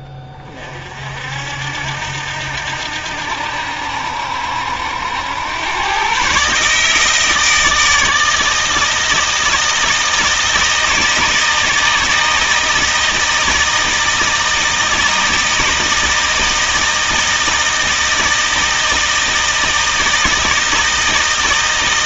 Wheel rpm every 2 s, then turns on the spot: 50, 80, 80, 150, 160, 160, 160, 160, 160, 160, 160.
none